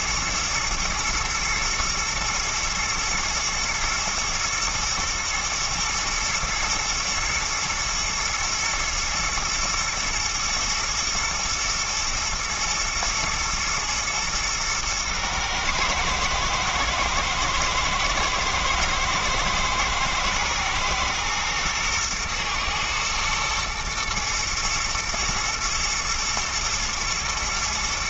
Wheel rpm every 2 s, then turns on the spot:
120, 110, 120, 120, 110, 110, 110, 110, 110, 110, 110, 120, 110, 110.
none